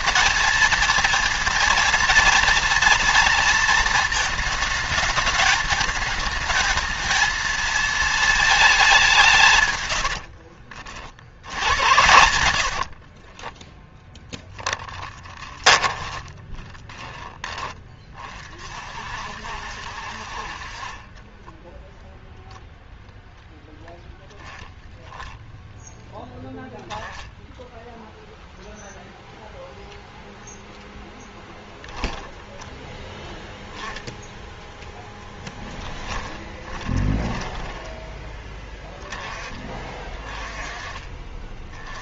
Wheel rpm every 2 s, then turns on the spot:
220, 230, 220, 220, 210, 50, 80, 10, 10, 40, 40, 10, 0, 10, 0, 0, 10, 0, 20, 10, 30.
10-18 20-22 36-38